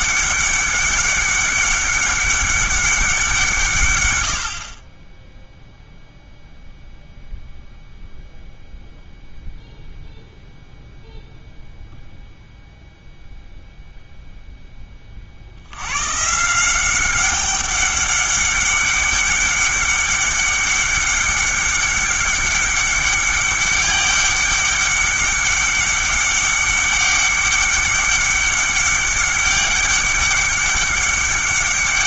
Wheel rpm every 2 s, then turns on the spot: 200, 200, 50, 0, 0, 0, 0, 10, 170, 200, 200, 200, 200, 200, 200, 200.
none